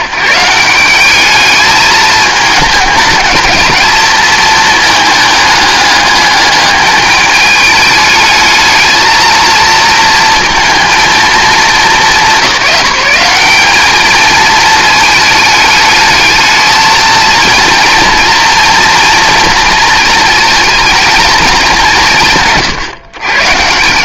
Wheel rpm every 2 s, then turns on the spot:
170, 210, 220, 210, 220, 220, 190, 220, 220, 230, 230, 150.
none